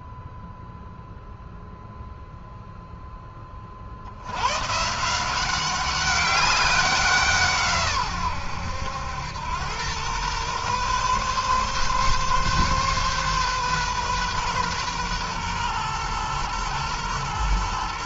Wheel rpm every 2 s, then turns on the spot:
0, 0, 150, 190, 100, 130, 130, 120, 110.
none